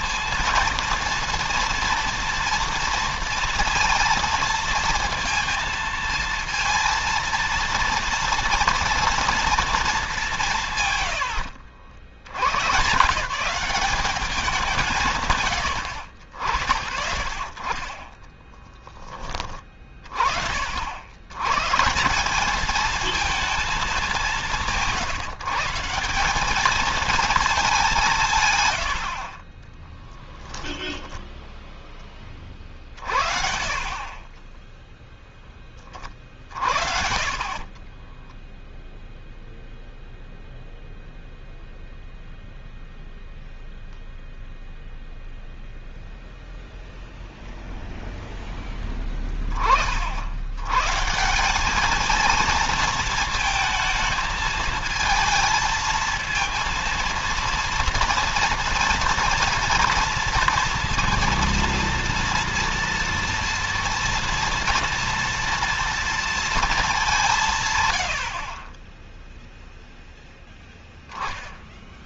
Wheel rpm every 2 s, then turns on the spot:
230, 230, 230, 230, 230, 130, 150, 150, 50, 10, 80, 220, 160, 220, 90, 10, 50, 10, 60, 0, 0, 0, 0, 0, 10, 150, 220, 220, 230, 240, 230, 230, 230, 200, 20, 10.
30-32 36-38